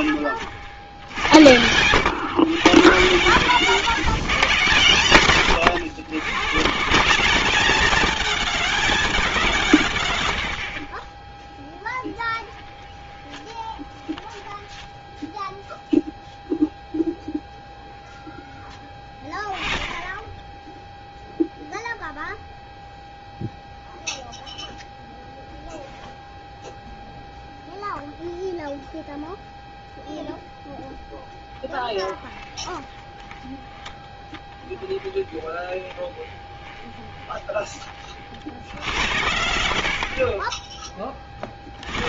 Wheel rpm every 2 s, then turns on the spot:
90, 150, 140, 160, 210, 70, 10, 10, 0, 10, 10, 0, 0, 0, 0, 0, 20, 20, 20, 80, 30.
10-16 18-22 32-38 40-42